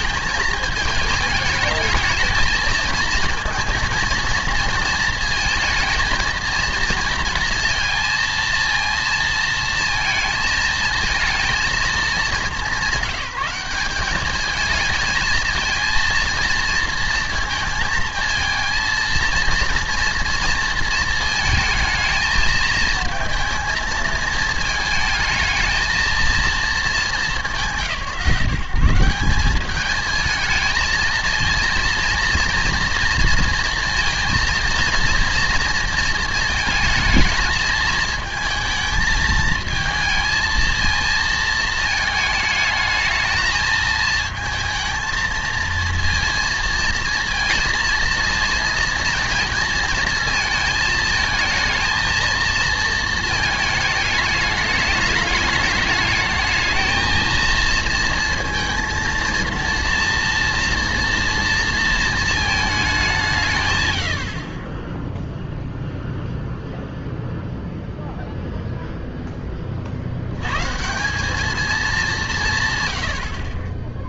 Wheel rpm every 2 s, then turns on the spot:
210, 220, 230, 230, 230, 230, 190, 210, 230, 220, 230, 220, 220, 230, 150, 220, 230, 230, 220, 220, 230, 220, 220, 230, 230, 220, 230, 210, 220, 230, 230, 220, 50, 0, 0, 110, 210.
none